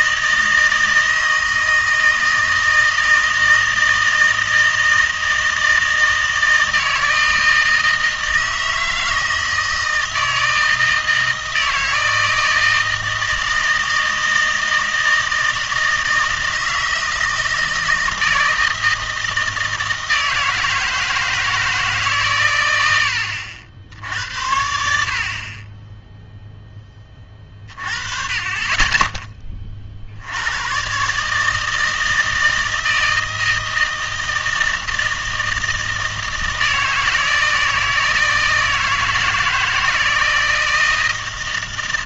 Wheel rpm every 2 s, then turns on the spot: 160, 160, 160, 160, 160, 160, 160, 160, 160, 160, 160, 110, 70, 10, 30, 120, 160, 160, 160, 160, 160.
none